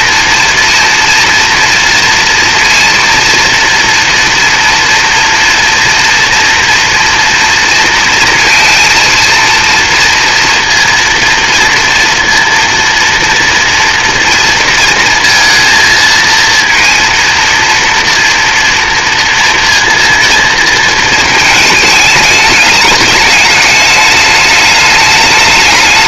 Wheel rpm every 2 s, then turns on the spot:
230, 240, 230, 230, 230, 230, 230, 230, 230, 230, 220, 210, 210.
none